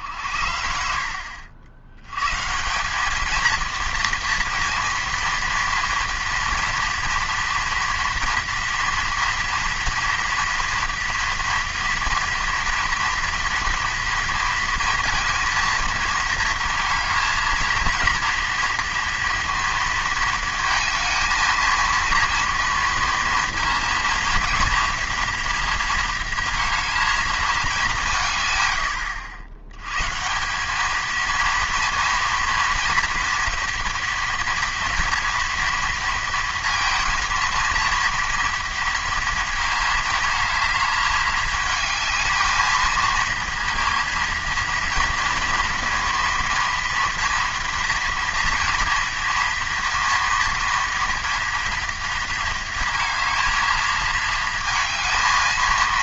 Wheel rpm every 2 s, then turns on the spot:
60, 160, 230, 230, 230, 230, 230, 230, 220, 230, 220, 230, 230, 220, 110, 190, 230, 230, 230, 230, 220, 220, 230, 230, 240, 230, 230, 220.
none